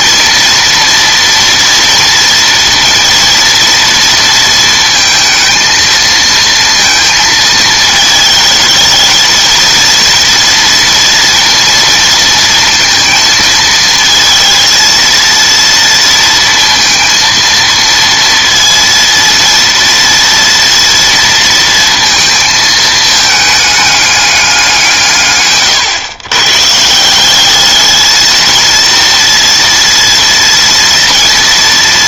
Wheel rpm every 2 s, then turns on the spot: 230, 230, 220, 230, 220, 230, 230, 230, 230, 230, 230, 220, 180, 130, 230, 230.
none